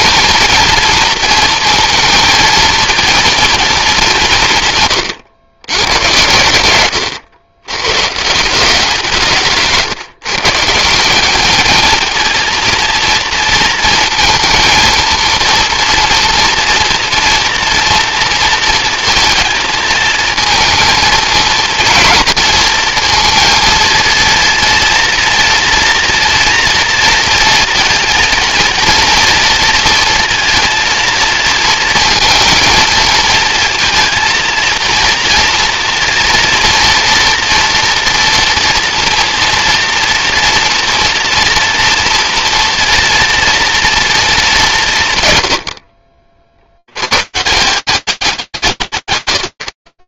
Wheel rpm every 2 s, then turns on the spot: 220, 230, 160, 90, 160, 150, 230, 230, 230, 230, 230, 230, 230, 230, 230, 230, 220, 230, 230, 230, 230, 230, 190, 70, 190.
none